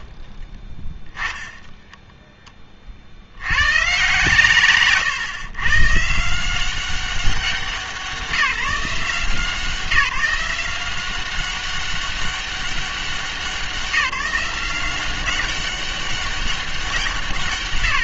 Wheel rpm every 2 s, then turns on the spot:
20, 20, 140, 180, 180, 170, 200, 180, 190.
0-2